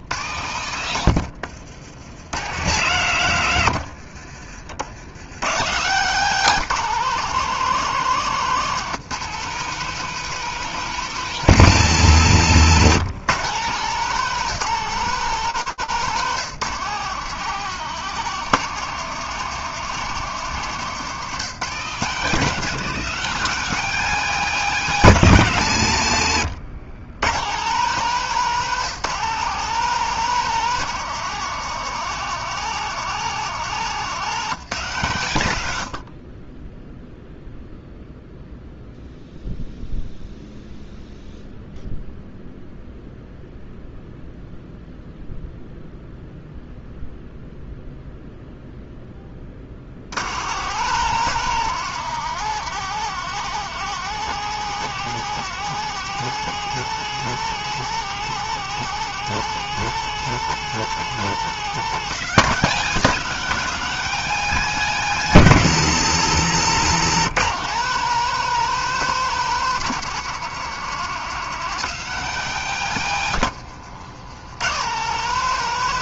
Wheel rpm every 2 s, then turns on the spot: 90, 70, 70, 160, 180, 190, 160, 160, 160, 180, 170, 160, 190, 110, 160, 190, 180, 170, 30, 0, 0, 0, 0, 0, 0, 120, 180, 190, 190, 190, 190, 190, 190, 170, 190, 180, 190, 80.
4-6 26-28 74-76